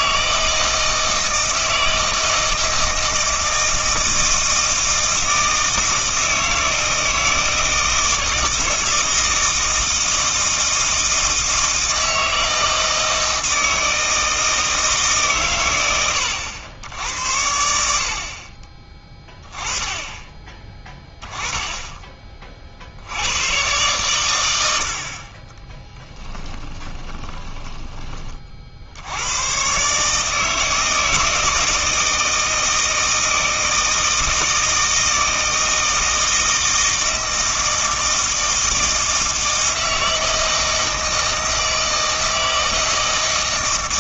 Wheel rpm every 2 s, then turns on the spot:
160, 160, 160, 160, 160, 160, 160, 160, 90, 30, 20, 50, 70, 20, 60, 160, 160, 160, 160, 160, 160, 160.
26-28